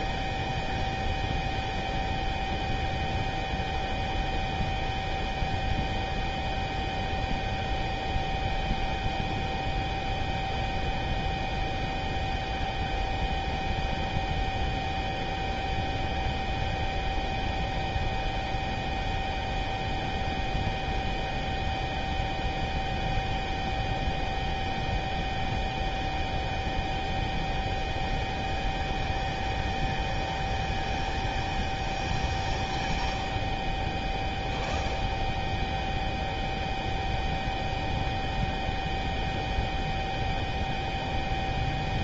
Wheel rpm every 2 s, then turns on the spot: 0, 0, 0, 0, 0, 0, 0, 0, 0, 0, 0, 0, 0, 0, 0, 0, 0, 0, 0, 0, 0.
none